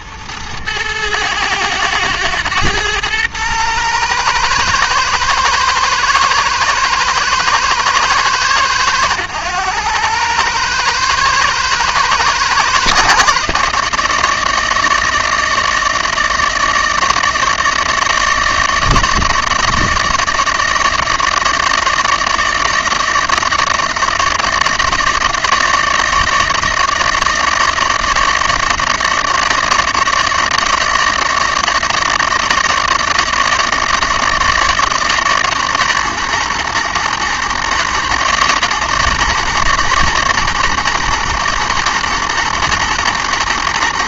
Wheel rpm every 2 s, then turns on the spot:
110, 110, 110, 110, 100, 110, 110, 120, 120, 120, 120, 130, 120, 120, 130, 120, 120, 120, 120, 120, 120, 120.
none